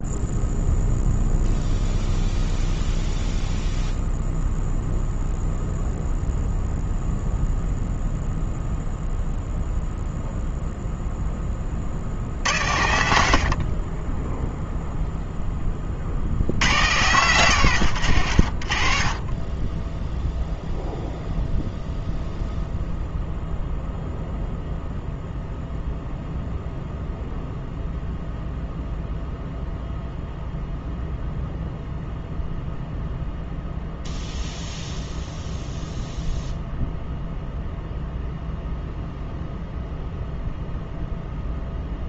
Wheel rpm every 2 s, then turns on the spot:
0, 0, 0, 0, 0, 0, 90, 0, 80, 70, 0, 0, 0, 0, 0, 0, 0, 0, 0, 0, 0.
none